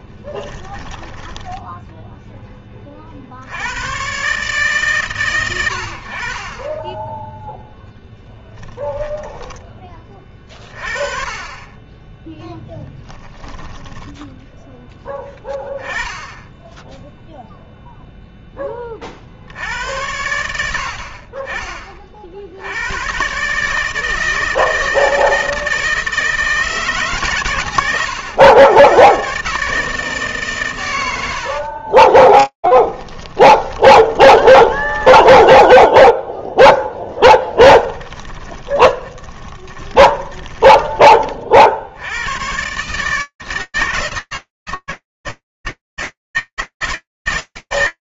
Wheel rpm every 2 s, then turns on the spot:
10, 30, 140, 20, 10, 30, 0, 10, 0, 10, 80, 90, 160, 160, 110, 110, 20, 10, 0, 10, 20, 140, 160, 160.
0-2 8-10 32-36 38-40